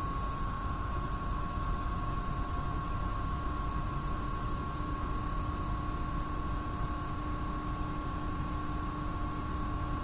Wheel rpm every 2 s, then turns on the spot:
0, 0, 0, 0, 0.
none